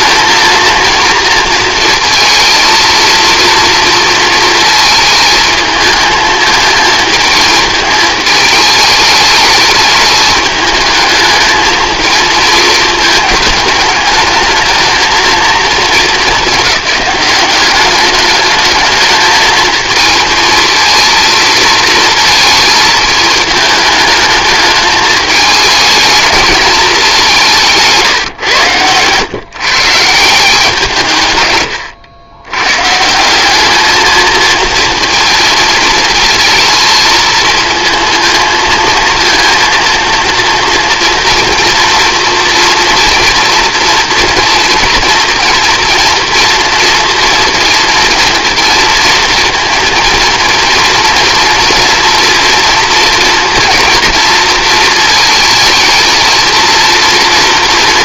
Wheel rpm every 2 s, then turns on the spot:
230, 230, 230, 220, 220, 210, 220, 220, 220, 210, 230, 220, 210, 220, 130, 170, 100, 220, 220, 230, 230, 230, 230, 230, 230, 230, 230, 230, 220.
none